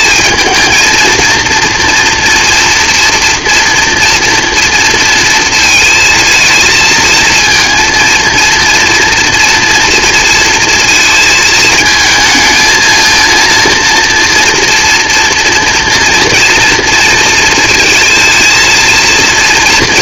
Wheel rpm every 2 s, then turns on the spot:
220, 230, 230, 220, 230, 230, 230, 230, 230, 230.
none